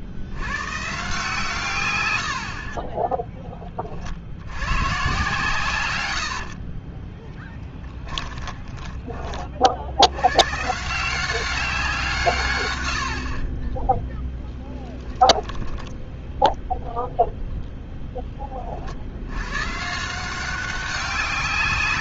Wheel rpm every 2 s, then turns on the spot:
120, 40, 100, 40, 20, 140, 120, 10, 0, 30, 190.
2-4 6-10 14-16